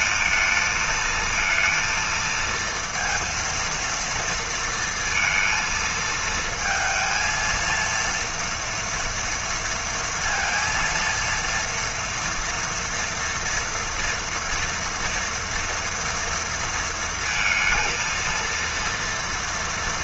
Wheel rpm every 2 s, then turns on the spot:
220, 230, 230, 230, 240, 230, 230, 230, 230, 230.
none